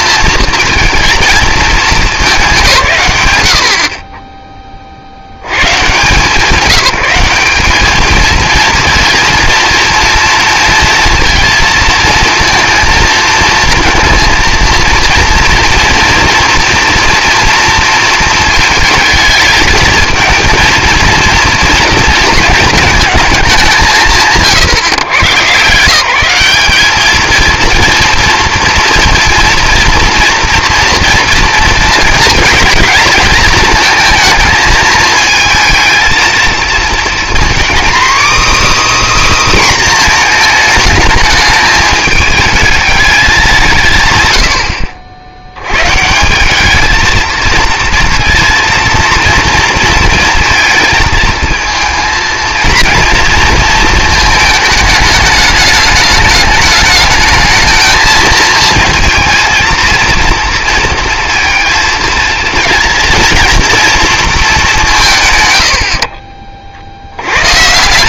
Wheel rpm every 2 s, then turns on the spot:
230, 210, 20, 180, 230, 230, 230, 230, 230, 220, 230, 230, 130, 190, 230, 230, 230, 220, 230, 300, 220, 220, 100, 200, 230, 220, 230, 220, 210, 230, 230, 230, 190, 50.
none